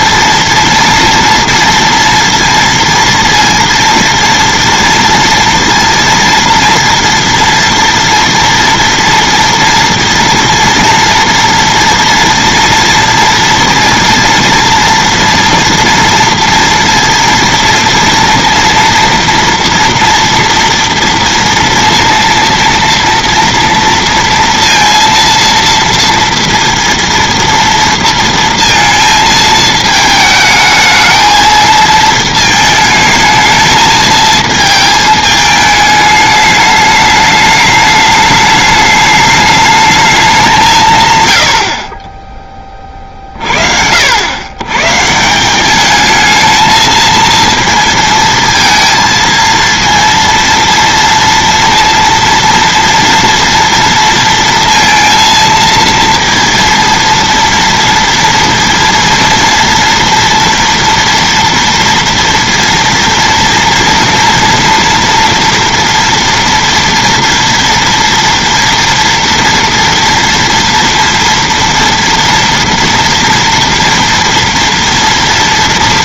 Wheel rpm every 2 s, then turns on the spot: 230, 230, 230, 240, 230, 230, 230, 230, 230, 230, 230, 230, 230, 230, 230, 220, 220, 220, 210, 210, 170, 10, 110, 220, 230, 230, 230, 230, 230, 230, 240, 230, 240, 230, 230, 230, 230, 230.
none